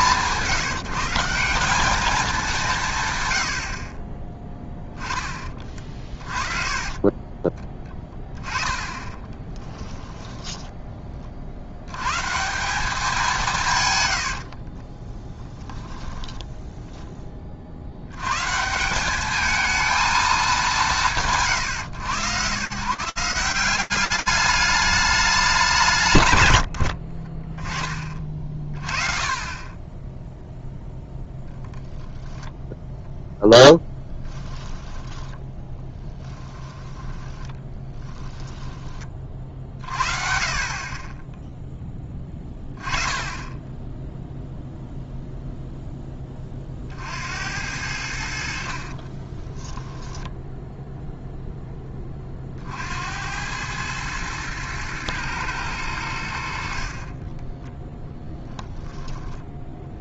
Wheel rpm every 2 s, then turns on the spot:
160, 190, 20, 50, 10, 10, 160, 80, 10, 150, 190, 120, 210, 80, 40, 0, 10, 10, 10, 10, 50, 10, 0, 30, 80, 10, 40, 110, 80, 0.
4-8 10-12 14-18 34-40 50-52